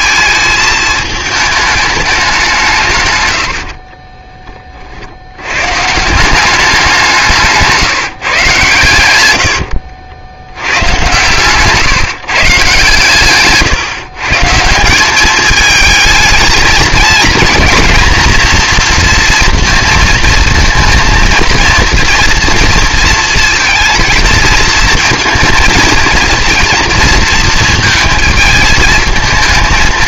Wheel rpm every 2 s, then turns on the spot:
220, 140, 40, 190, 100, 100, 140, 170, 230, 240, 230, 230, 230, 230, 220.
none